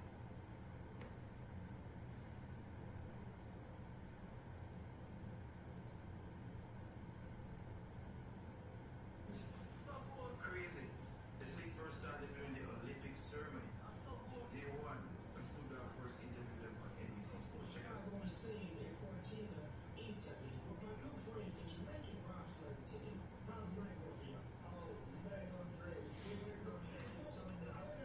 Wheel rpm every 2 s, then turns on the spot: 0, 0, 0, 0, 0, 0, 0, 0, 0, 0, 0, 0, 0, 0.
none